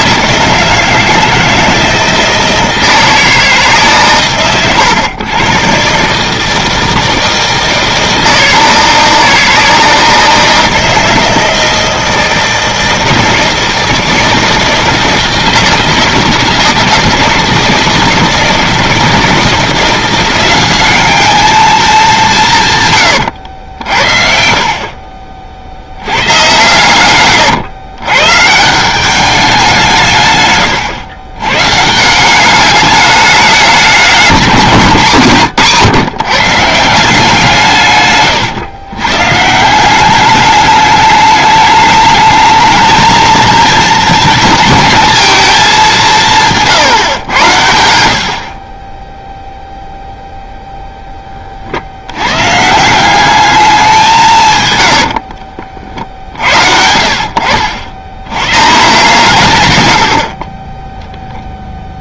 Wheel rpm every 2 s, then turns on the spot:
160, 160, 100, 160, 160, 160, 160, 160, 160, 160, 190, 150, 50, 110, 150, 130, 200, 190, 160, 130, 210, 220, 220, 160, 50, 0, 140, 130, 60, 130, 30.
none